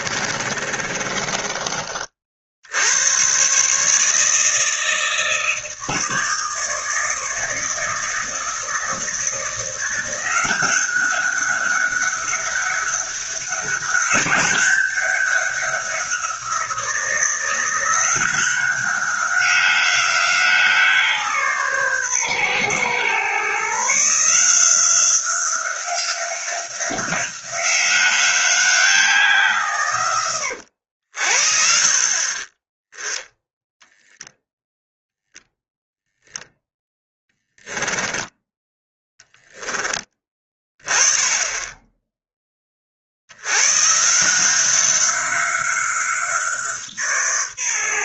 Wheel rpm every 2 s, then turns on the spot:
30, 70, 160, 160, 160, 180, 200, 200, 180, 180, 170, 120, 170, 180, 180, 80, 20, 0, 0, 10, 20, 20, 180, 170.
0-2